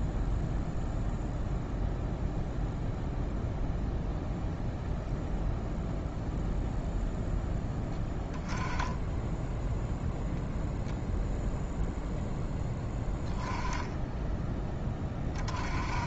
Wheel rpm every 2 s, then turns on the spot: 0, 0, 0, 0, 10, 0, 10, 10.
none